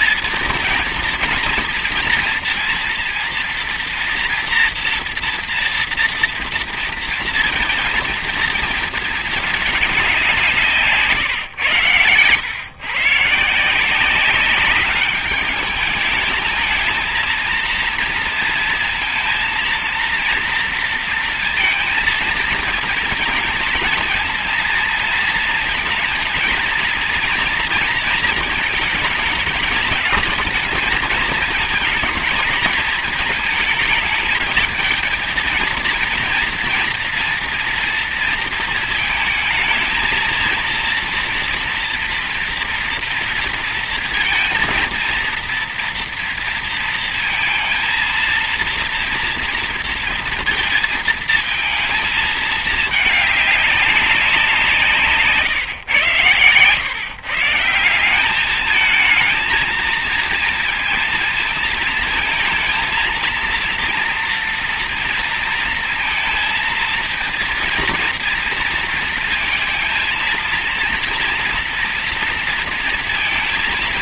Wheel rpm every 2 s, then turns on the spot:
230, 230, 230, 230, 220, 140, 140, 200, 220, 230, 230, 230, 230, 230, 220, 220, 220, 220, 240, 230, 230, 230, 230, 230, 230, 230, 210, 150, 130, 220, 230, 230, 230, 230, 230, 230, 230.
10-12